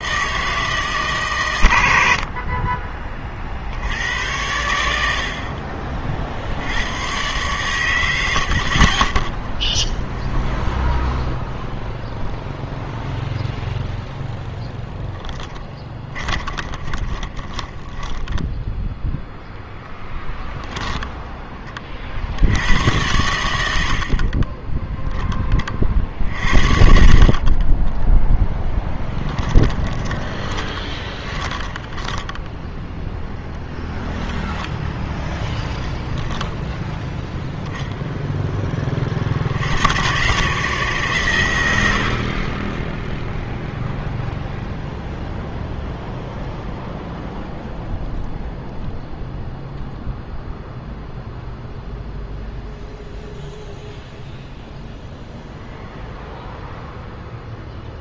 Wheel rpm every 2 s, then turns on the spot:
160, 30, 90, 70, 50, 0, 0, 0, 30, 10, 10, 80, 20, 60, 0, 20, 10, 0, 0, 10, 140, 20, 0, 0, 0, 0, 0, 0, 0.
8-10 16-18 24-26 30-34